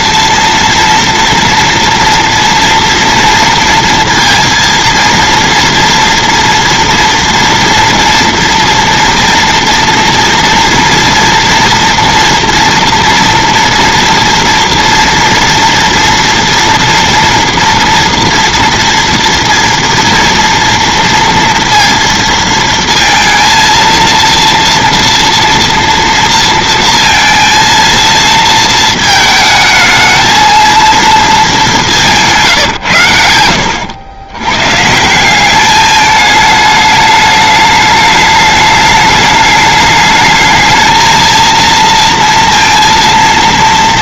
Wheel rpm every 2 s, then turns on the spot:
230, 240, 230, 230, 230, 230, 240, 230, 230, 240, 230, 230, 230, 230, 230, 230, 150, 110, 210, 210, 210, 230.
32-34